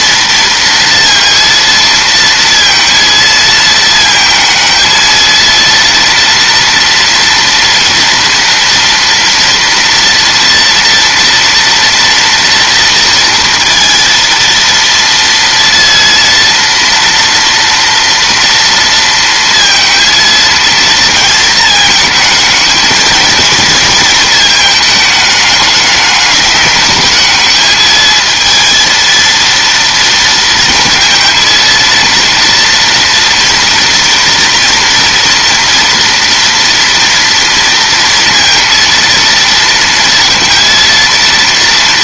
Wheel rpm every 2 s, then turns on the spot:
230, 230, 220, 230, 240, 230, 230, 230, 230, 230, 230, 220, 220, 210, 230, 230, 230, 230, 240, 230, 230.
none